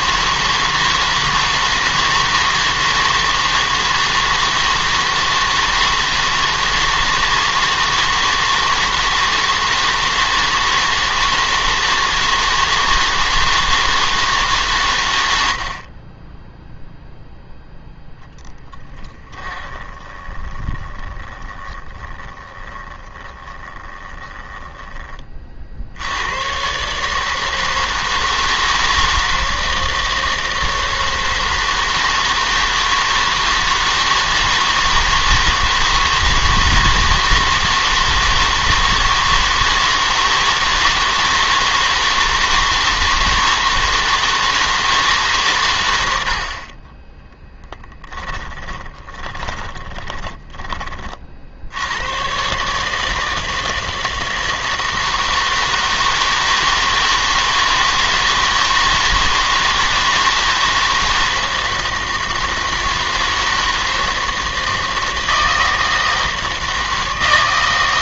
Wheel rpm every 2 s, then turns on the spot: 160, 160, 160, 160, 160, 160, 160, 150, 10, 10, 20, 20, 10, 130, 160, 160, 160, 160, 160, 160, 160, 160, 160, 30, 20, 20, 140, 160, 160, 160, 160, 160, 160, 160.
18-26 48-50